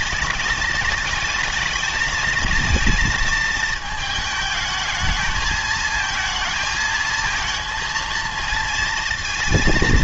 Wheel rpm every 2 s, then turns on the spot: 210, 220, 220, 220, 230.
none